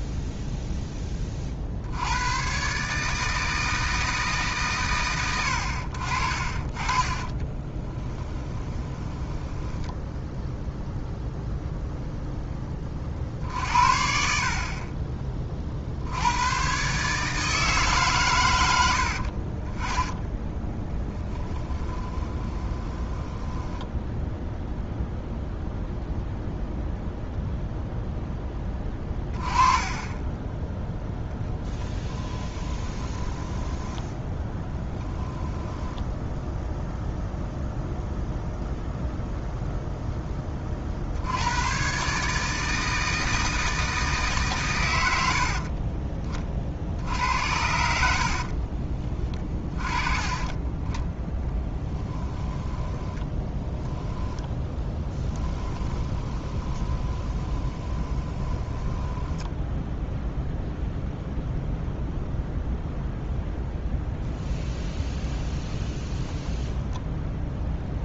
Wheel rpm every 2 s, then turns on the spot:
0, 130, 130, 40, 10, 0, 20, 40, 120, 90, 10, 20, 0, 0, 10, 10, 10, 10, 0, 0, 20, 160, 120, 50, 40, 20, 10, 10, 20, 10, 0, 0, 0, 0.
8-10 20-24 30-36 48-50 52-60